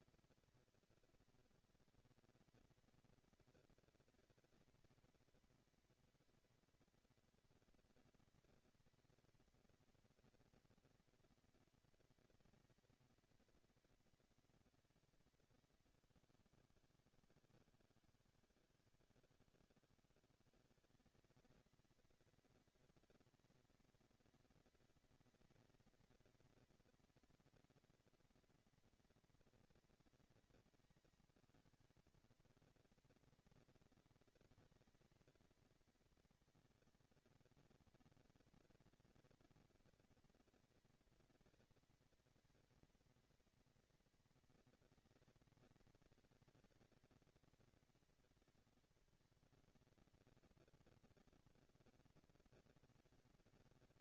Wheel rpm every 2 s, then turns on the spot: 230, 230, 230, 240, 230, 230, 230, 230, 190, 160, 180, 230, 230, 230, 230, 220, 200, 230, 230, 230, 230, 230, 220, 220, 230, 230, 230.
none